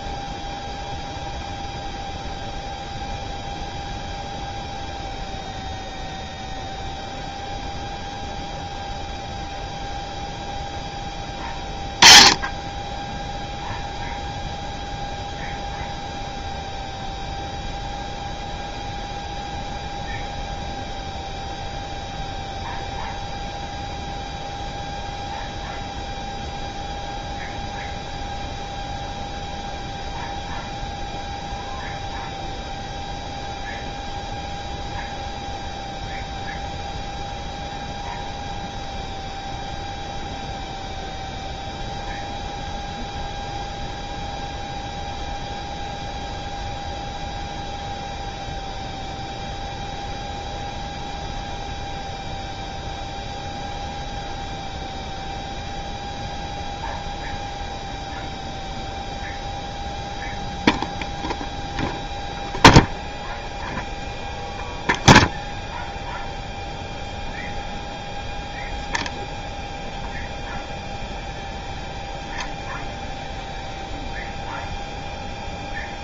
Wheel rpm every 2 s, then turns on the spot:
0, 0, 0, 0, 0, 10, 0, 0, 0, 0, 0, 0, 0, 0, 0, 0, 0, 0, 0, 0, 0, 0, 0, 0, 0, 0, 0, 0, 0, 0, 0, 0, 0, 0, 0, 0, 0, 0.
none